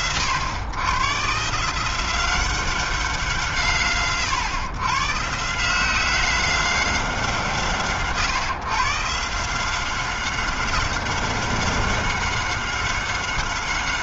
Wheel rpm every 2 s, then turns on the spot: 120, 120, 160, 130, 160, 190, 190.
none